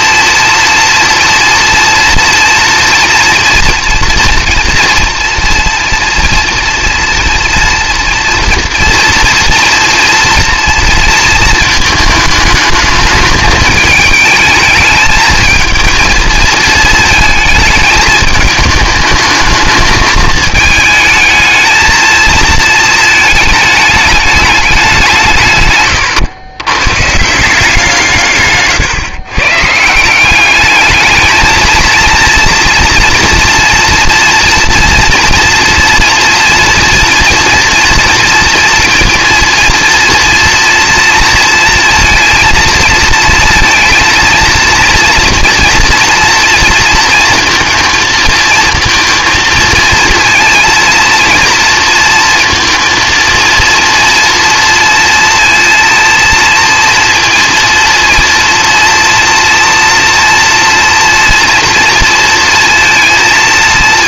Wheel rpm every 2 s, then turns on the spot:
230, 240, 230, 230, 240, 230, 220, 220, 220, 210, 220, 230, 200, 120, 140, 210, 230, 230, 230, 230, 230, 230, 230, 230, 230, 230, 230, 230, 230, 230, 240, 230.
none